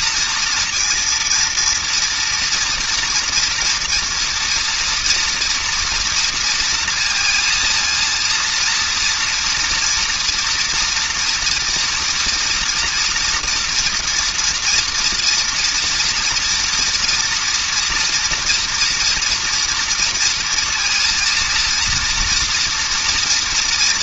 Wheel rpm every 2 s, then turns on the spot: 230, 230, 230, 230, 230, 230, 230, 240, 230, 240, 230, 230.
none